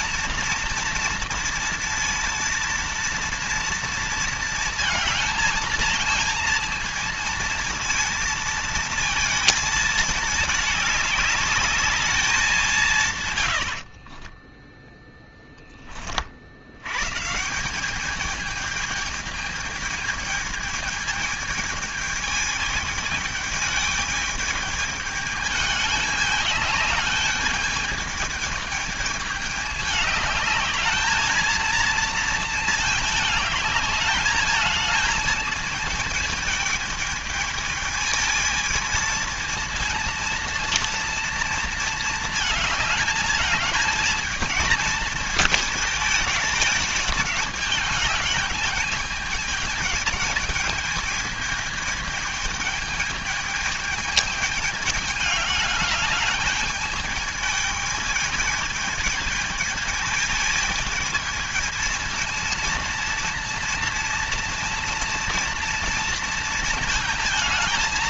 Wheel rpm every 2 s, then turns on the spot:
230, 230, 220, 230, 230, 210, 160, 0, 120, 210, 220, 220, 220, 210, 220, 220, 220, 220, 220, 220, 230, 210, 220, 210, 220, 220, 220, 210, 210, 220, 220, 230, 230, 230.
none